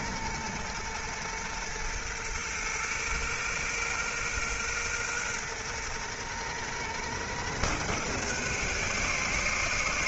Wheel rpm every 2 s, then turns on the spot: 120, 120, 120, 120, 140.
none